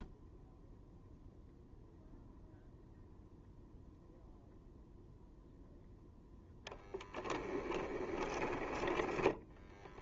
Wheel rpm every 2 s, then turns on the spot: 0, 0, 0, 10, 20.
6-10